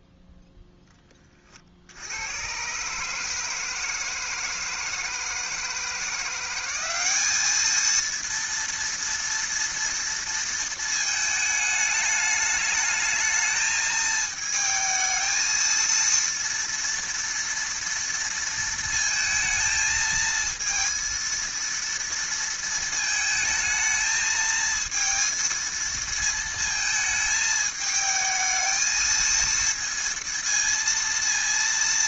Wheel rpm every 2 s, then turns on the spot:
20, 140, 160, 200, 230, 220, 210, 220, 230, 230, 230, 230, 230, 220, 220, 230.
none